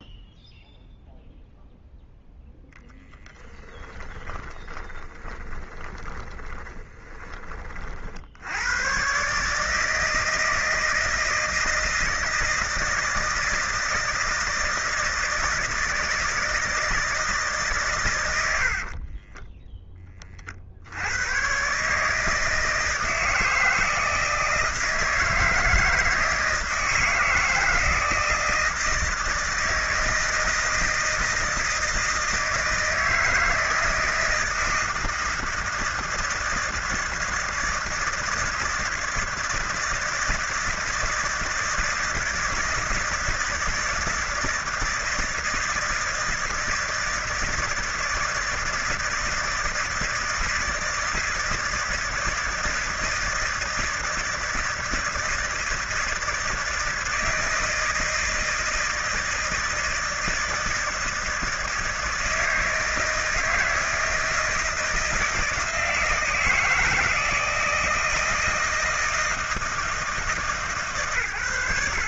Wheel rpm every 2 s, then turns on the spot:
0, 0, 20, 20, 100, 160, 160, 160, 160, 70, 50, 160, 160, 160, 170, 160, 160, 160, 160, 160, 160, 160, 160, 160, 160, 160, 160, 160, 160, 160, 160, 160, 160, 160, 160, 150.
4-8